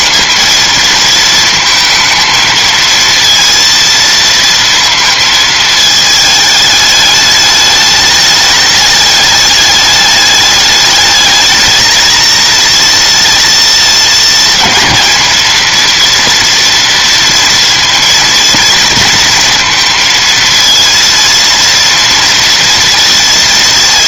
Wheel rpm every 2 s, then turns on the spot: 230, 230, 230, 210, 210, 210, 230, 220, 240, 230, 230, 230.
none